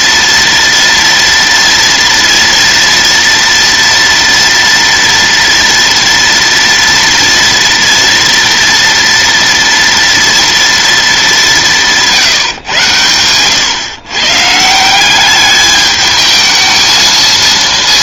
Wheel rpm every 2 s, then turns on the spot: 230, 230, 230, 230, 230, 230, 130, 150, 220.
none